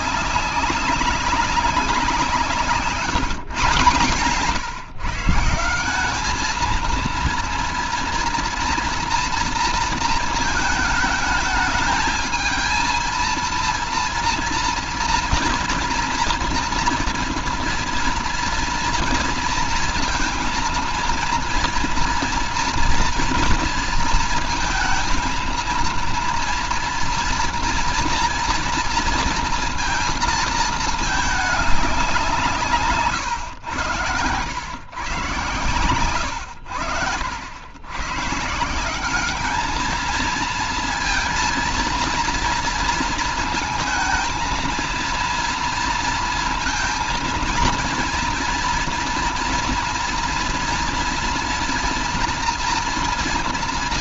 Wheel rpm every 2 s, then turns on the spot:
200, 170, 160, 230, 230, 220, 230, 230, 230, 230, 230, 230, 230, 230, 230, 210, 120, 120, 90, 200, 230, 230, 230, 230, 230, 240, 230.
none